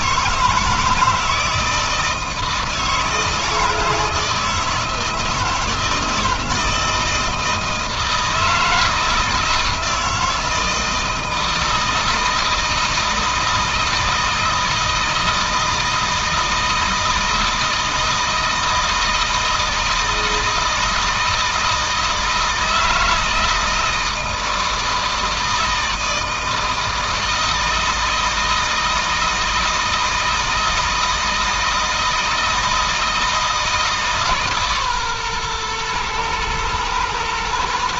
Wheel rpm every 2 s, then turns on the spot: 160, 160, 160, 160, 160, 160, 160, 160, 160, 160, 160, 160, 160, 160, 160, 160, 160, 130, 110.
none